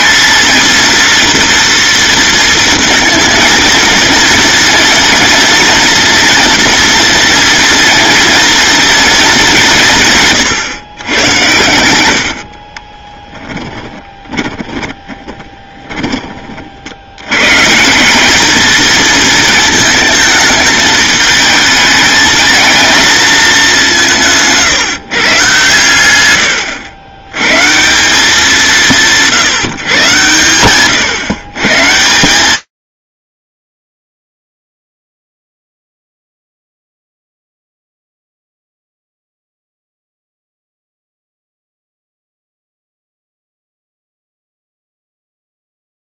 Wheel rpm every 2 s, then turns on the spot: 230, 230, 230, 230, 230, 120, 20, 20, 70, 220, 220, 220, 160, 100, 170, 110, 140, 0, 0, 0, 0, 0, 0.
12-16